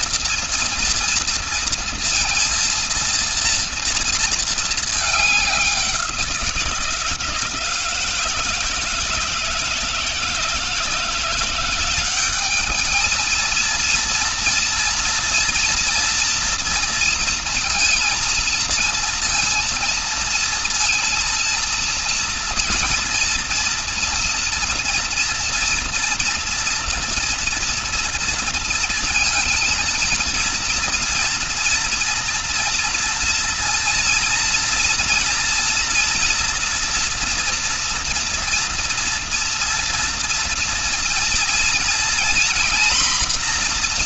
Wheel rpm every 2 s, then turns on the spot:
230, 230, 220, 170, 160, 160, 210, 230, 230, 230, 230, 230, 230, 230, 230, 230, 230, 230, 230, 230, 230, 240.
none